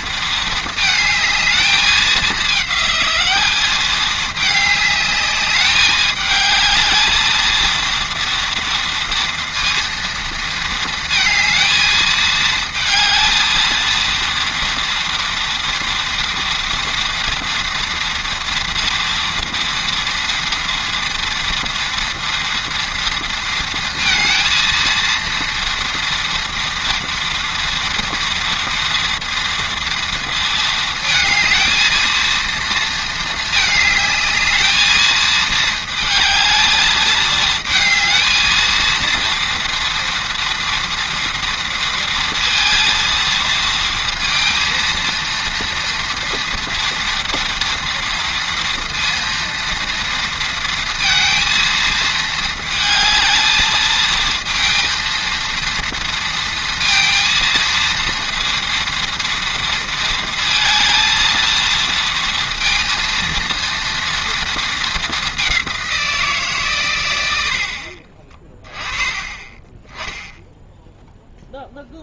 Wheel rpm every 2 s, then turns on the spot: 220, 210, 210, 220, 230, 230, 220, 230, 230, 230, 230, 230, 230, 230, 230, 220, 220, 220, 220, 230, 230, 230, 230, 230, 230, 230, 220, 230, 230, 230, 230, 230, 220, 100, 20, 0.
none